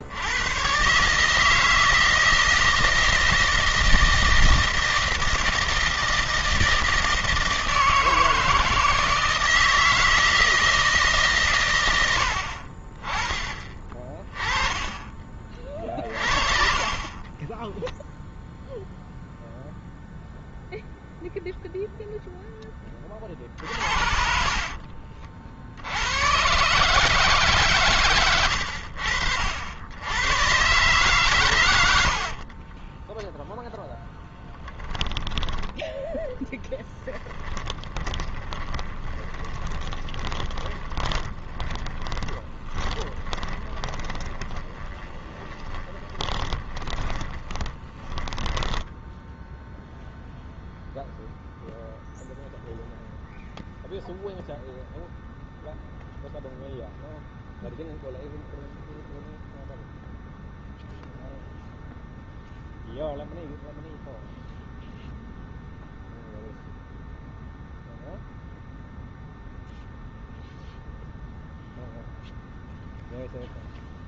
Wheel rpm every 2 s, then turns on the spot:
130, 160, 160, 160, 160, 160, 40, 30, 20, 0, 0, 20, 50, 150, 90, 120, 20, 30, 10, 20, 20, 20, 20, 20, 10, 0, 0, 0, 0, 0, 0, 0, 0, 0, 0, 0, 0.
16-18 24-26 36-50